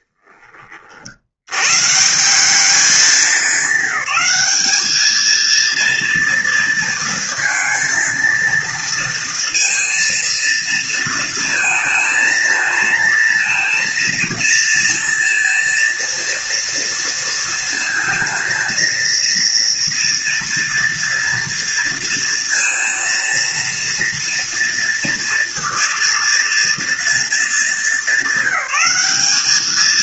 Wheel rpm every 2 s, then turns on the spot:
90, 200, 220, 230, 230, 230, 230, 230, 230, 230, 230, 230, 230, 220, 210.
none